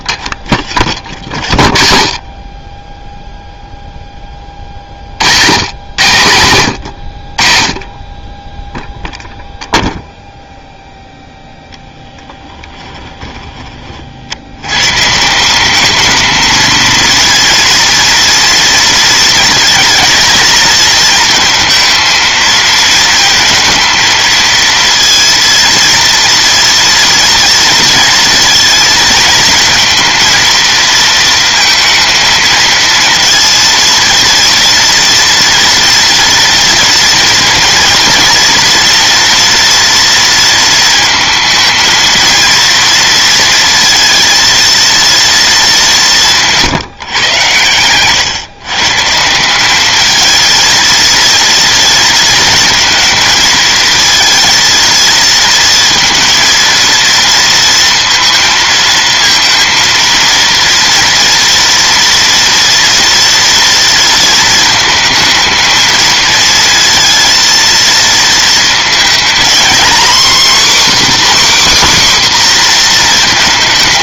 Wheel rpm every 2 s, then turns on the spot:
50, 20, 30, 100, 10, 0, 10, 90, 220, 230, 220, 220, 230, 230, 230, 230, 220, 230, 230, 240, 230, 230, 230, 160, 140, 220, 230, 230, 230, 230, 230, 240, 220, 230, 220, 270, 250.
12-14